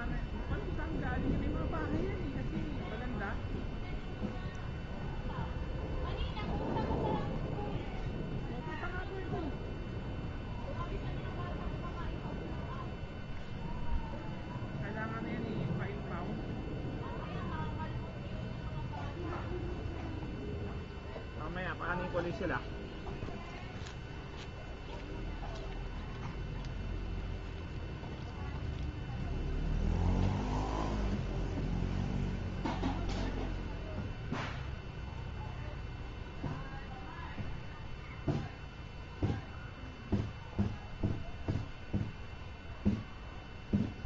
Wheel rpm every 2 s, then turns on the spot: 0, 0, 0, 0, 0, 0, 0, 0, 0, 0, 0, 0, 0, 0, 0, 0, 0, 0, 0, 0, 0, 0.
none